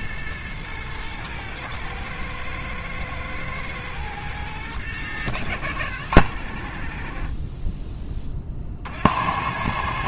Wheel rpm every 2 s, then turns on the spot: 110, 110, 110, 60, 60.
none